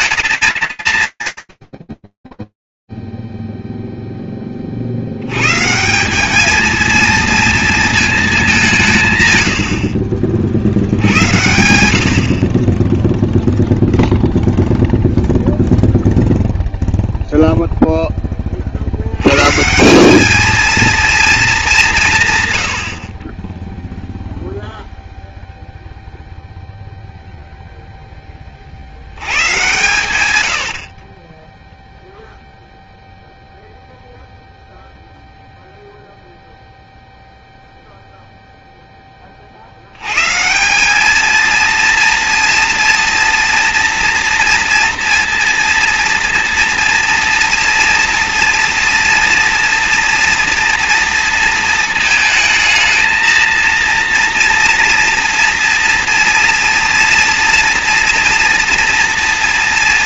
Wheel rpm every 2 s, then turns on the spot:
130, 0, 10, 190, 220, 50, 60, 0, 0, 30, 220, 110, 0, 0, 100, 20, 0, 0, 0, 90, 230, 230, 230, 230, 230, 220, 230, 230, 230, 230.
none